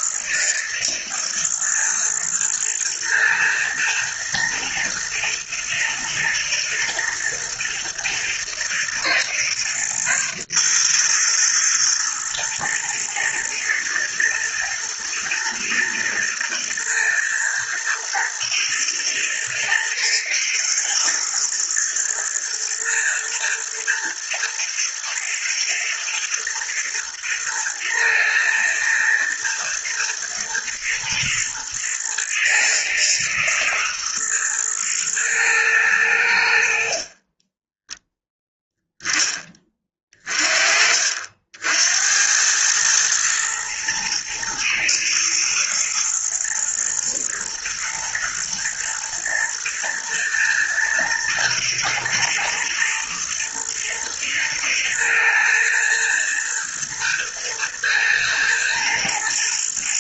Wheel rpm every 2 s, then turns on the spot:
110, 110, 110, 110, 110, 120, 120, 110, 110, 110, 110, 120, 120, 110, 120, 110, 120, 110, 60, 10, 40, 110, 110, 110, 120, 120, 110, 110, 110, 110.
none